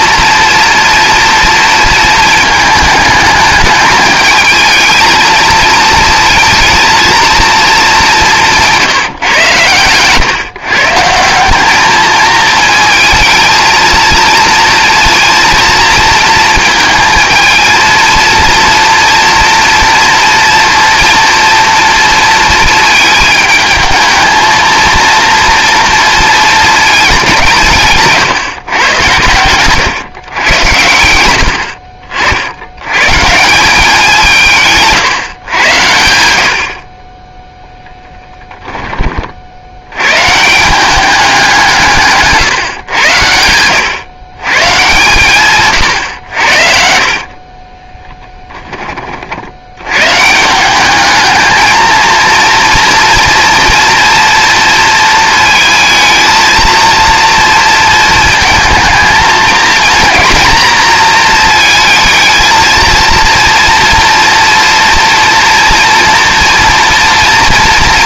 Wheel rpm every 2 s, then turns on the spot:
230, 220, 220, 230, 170, 150, 220, 230, 220, 230, 230, 220, 220, 220, 140, 100, 100, 160, 60, 10, 170, 130, 140, 70, 20, 180, 230, 230, 230, 230, 230, 230, 230, 230.
46-48